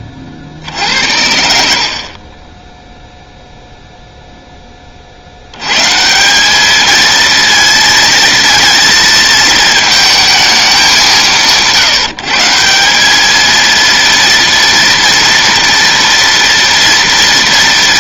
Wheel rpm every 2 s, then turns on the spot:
60, 0, 40, 220, 230, 190, 190, 230, 230.
none